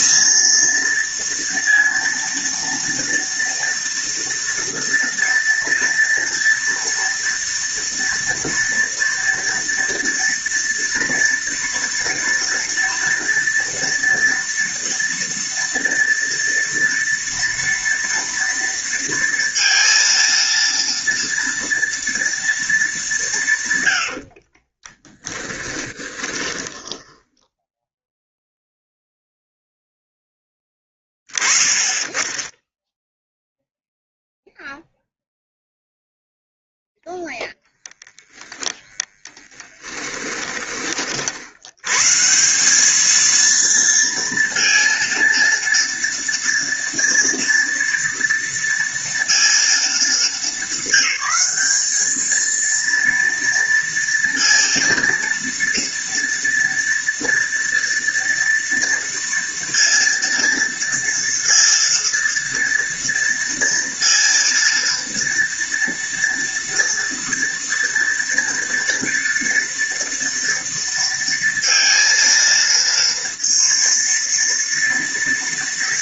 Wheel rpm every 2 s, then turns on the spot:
230, 230, 230, 230, 230, 240, 240, 230, 230, 230, 230, 220, 40, 10, 0, 20, 0, 0, 0, 30, 20, 200, 230, 230, 230, 200, 230, 230, 230, 230, 230, 230, 230, 230, 230, 230, 230, 230.
24-28